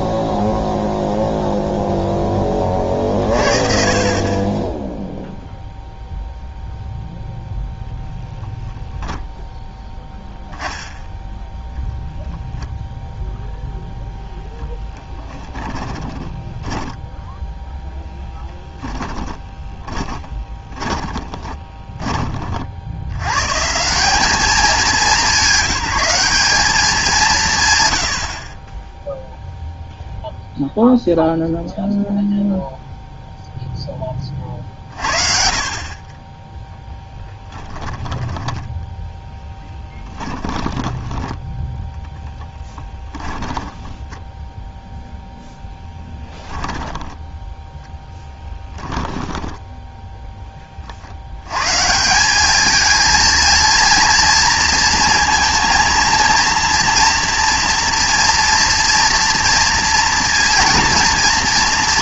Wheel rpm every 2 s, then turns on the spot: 0, 50, 10, 0, 0, 10, 0, 20, 10, 10, 20, 70, 190, 210, 40, 0, 0, 40, 10, 10, 10, 10, 0, 10, 10, 30, 210, 230, 230, 230, 230.
14-22 40-44 46-50